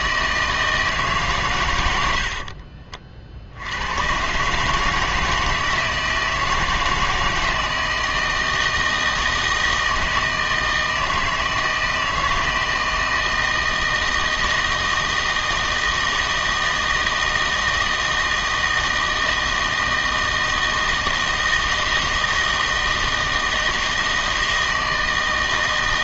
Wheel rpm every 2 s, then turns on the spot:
160, 50, 150, 160, 160, 160, 160, 160, 160, 160, 160, 160, 160.
2-4